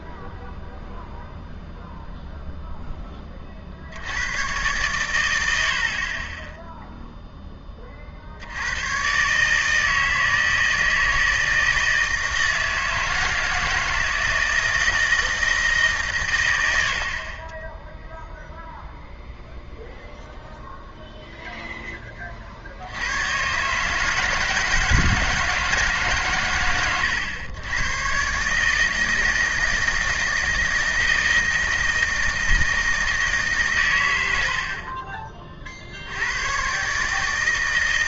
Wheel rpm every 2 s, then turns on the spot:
0, 0, 110, 0, 100, 160, 160, 170, 60, 0, 0, 80, 160, 110, 160, 160, 160, 40, 130.
none